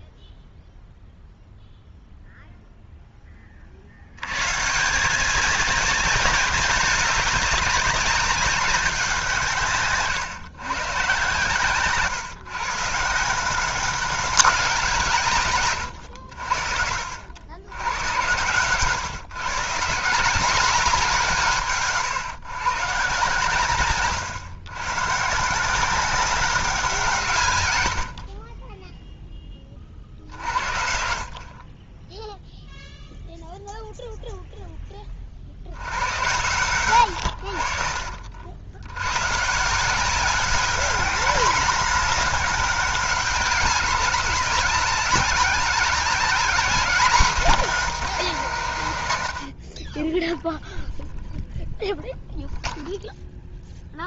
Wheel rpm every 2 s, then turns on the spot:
0, 0, 140, 210, 200, 140, 150, 180, 60, 130, 190, 140, 120, 190, 10, 50, 0, 10, 100, 80, 200, 200, 200, 210, 170, 0, 0.
28-30